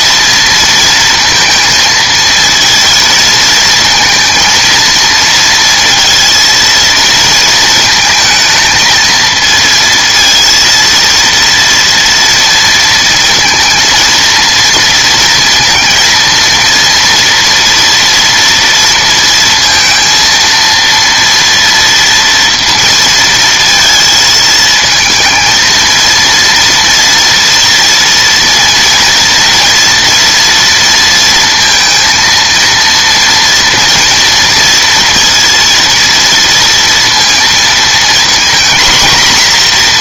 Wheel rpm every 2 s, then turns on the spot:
230, 230, 230, 230, 220, 230, 230, 230, 230, 230, 230, 230, 220, 240, 230, 230, 230, 230, 230, 240.
none